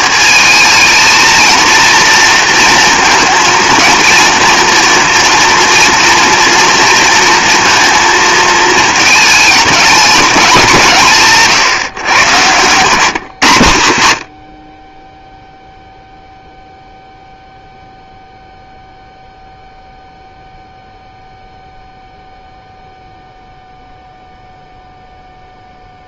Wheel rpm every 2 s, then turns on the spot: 220, 230, 230, 230, 220, 160, 140, 30, 0, 0, 0, 0, 0.
12-14